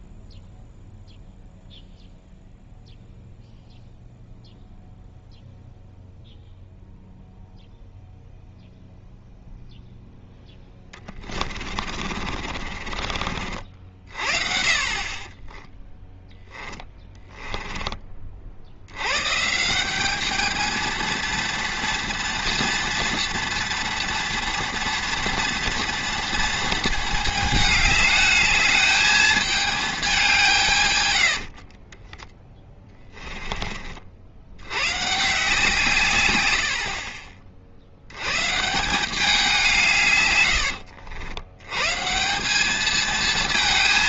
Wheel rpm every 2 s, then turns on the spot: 0, 0, 0, 0, 0, 20, 40, 40, 10, 100, 230, 230, 230, 220, 210, 130, 20, 130, 60, 170, 90, 220.
10-14 16-18 32-34 40-42